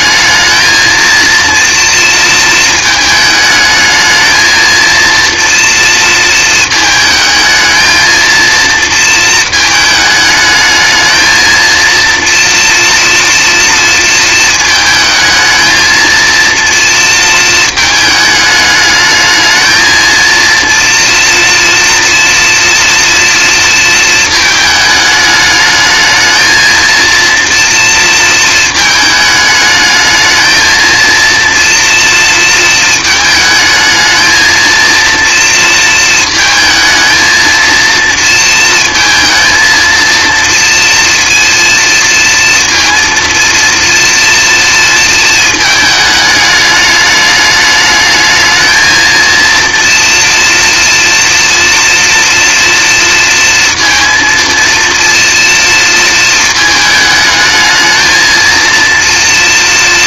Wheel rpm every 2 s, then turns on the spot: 220, 220, 230, 220, 230, 220, 230, 220, 230, 210, 230, 230, 220, 220, 220, 230, 220, 230, 220, 230, 230, 230, 230, 210, 230, 240, 230, 230, 220, 230.
none